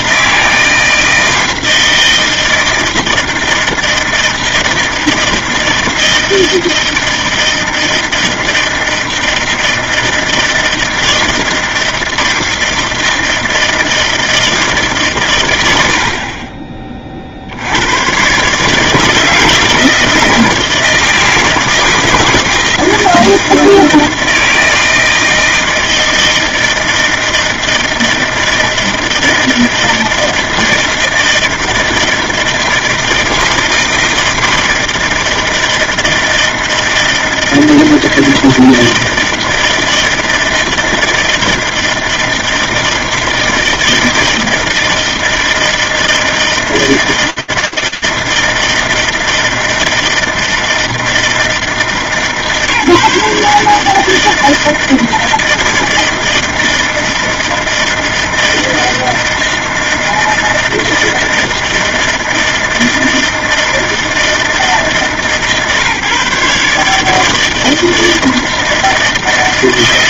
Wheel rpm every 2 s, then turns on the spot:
160, 160, 160, 160, 160, 160, 160, 160, 40, 140, 160, 160, 160, 160, 160, 160, 160, 160, 160, 160, 160, 160, 160, 160, 160, 160, 150, 160, 160, 160, 160, 160, 150, 150, 160.
none